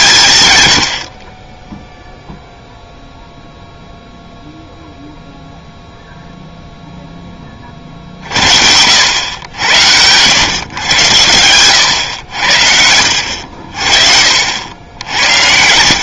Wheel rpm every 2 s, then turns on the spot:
120, 0, 0, 0, 70, 110, 80, 70.
none